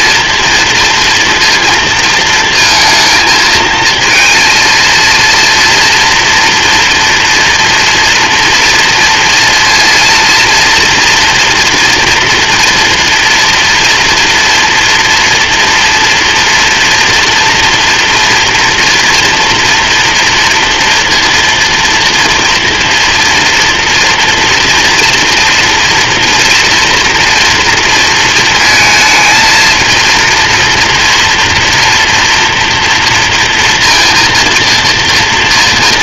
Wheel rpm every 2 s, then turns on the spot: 230, 220, 230, 230, 230, 240, 240, 230, 230, 240, 230, 230, 230, 230, 220, 230, 230, 230.
none